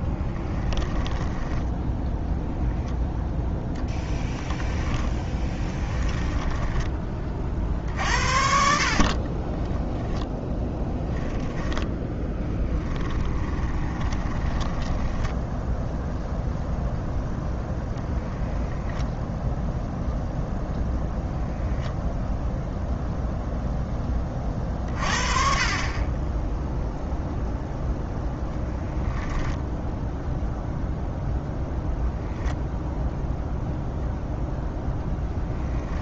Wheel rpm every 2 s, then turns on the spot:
10, 0, 20, 10, 50, 10, 10, 10, 0, 10, 0, 0, 40, 0, 0, 0, 0, 0.
0-2 4-6 8-16 18-20